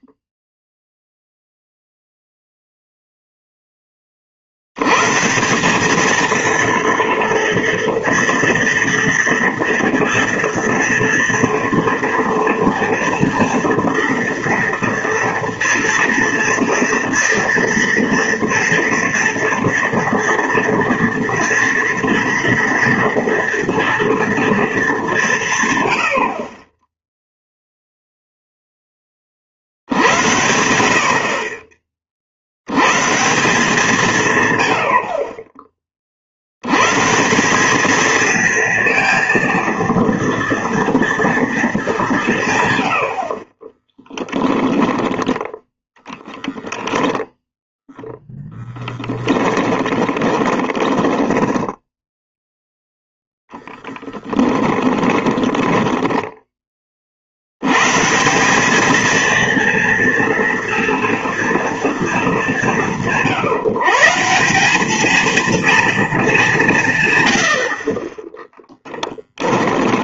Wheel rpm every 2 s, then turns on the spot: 0, 0, 80, 230, 230, 230, 230, 230, 230, 230, 230, 230, 220, 30, 0, 80, 80, 110, 90, 220, 240, 140, 10, 10, 10, 20, 0, 20, 20, 200, 230, 190, 190, 190, 10.
48-52 54-56 68-70